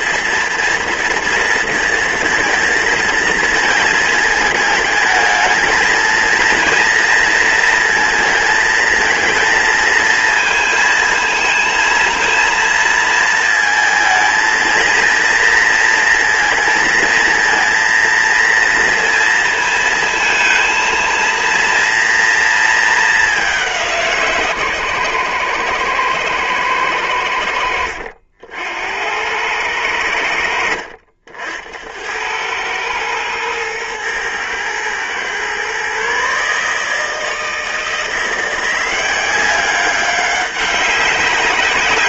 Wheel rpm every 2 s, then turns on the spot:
230, 230, 220, 230, 230, 220, 230, 230, 230, 230, 220, 220, 130, 110, 80, 70, 110, 120, 160, 180, 190.
none